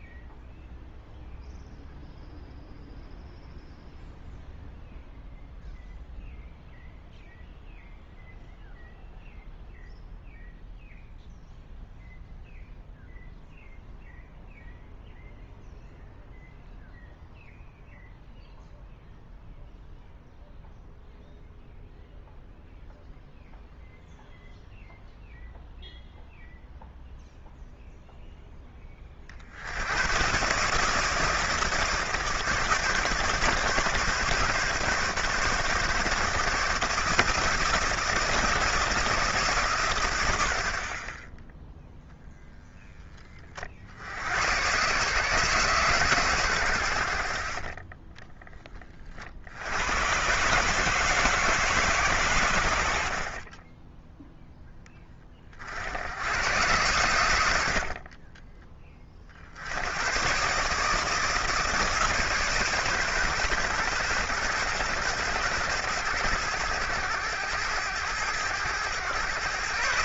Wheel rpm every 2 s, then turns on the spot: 0, 0, 0, 0, 0, 0, 0, 0, 0, 0, 0, 0, 0, 0, 10, 140, 150, 140, 150, 160, 70, 0, 110, 100, 20, 150, 90, 10, 100, 30, 150, 140, 120, 100, 110.
none